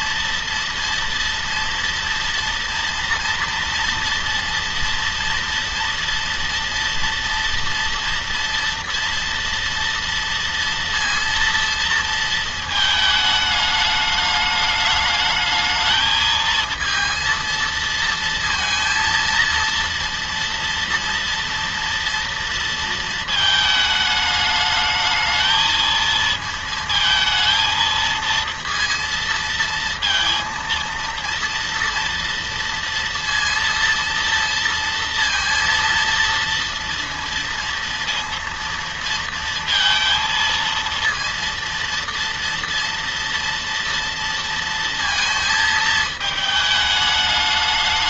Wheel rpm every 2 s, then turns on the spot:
230, 240, 230, 230, 230, 230, 230, 210, 230, 230, 230, 230, 220, 220, 230, 230, 230, 230, 230, 230, 230, 230, 230, 220.
none